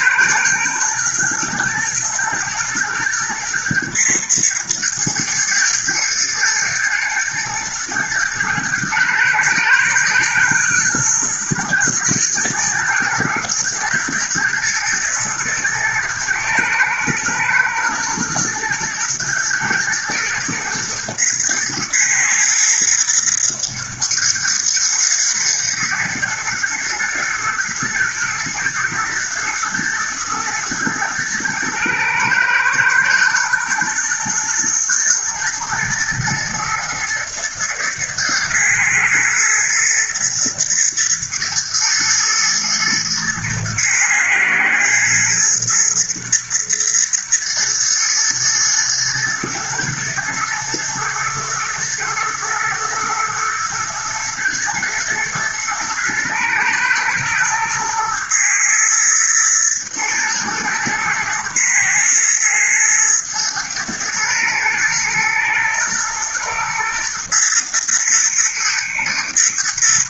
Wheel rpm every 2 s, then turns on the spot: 110, 120, 110, 120, 120, 120, 110, 120, 110, 120, 120, 120, 110, 120, 110, 110, 110, 120, 120, 110, 110, 120, 110, 110, 120, 110, 120, 120, 120, 110, 110, 120, 110, 120, 120.
none